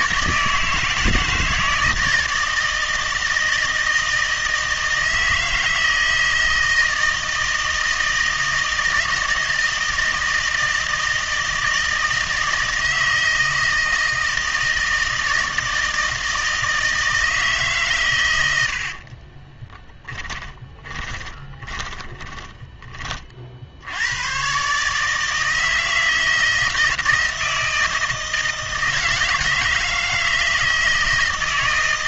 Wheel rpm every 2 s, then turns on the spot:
160, 160, 160, 160, 160, 160, 160, 160, 160, 80, 20, 20, 140, 160, 160, 160.
18-22